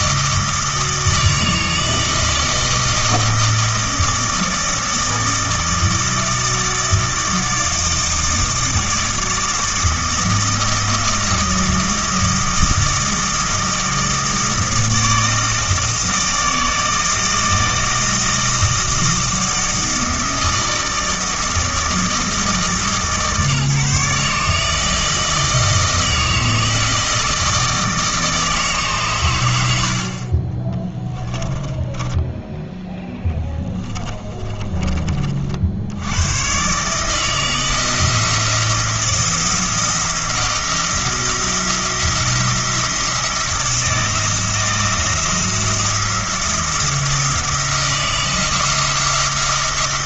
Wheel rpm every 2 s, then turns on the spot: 160, 160, 160, 160, 160, 160, 160, 160, 160, 160, 160, 150, 160, 160, 150, 20, 10, 30, 140, 170, 170, 170, 170, 170, 170.
30-32 34-36